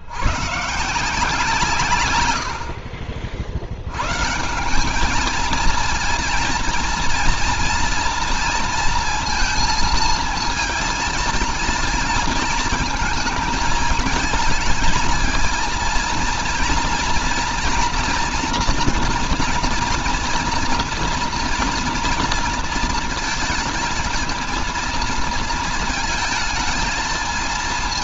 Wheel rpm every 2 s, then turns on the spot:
140, 70, 180, 230, 230, 230, 220, 220, 230, 230, 230, 230, 230, 220.
none